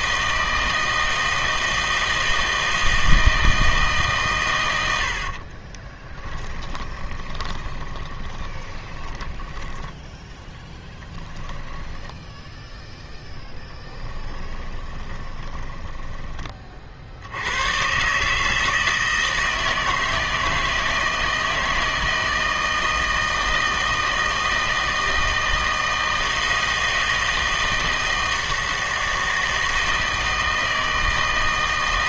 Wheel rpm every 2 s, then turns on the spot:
160, 160, 110, 20, 20, 20, 0, 20, 30, 160, 160, 160, 160, 160, 160, 160.
6-12 14-16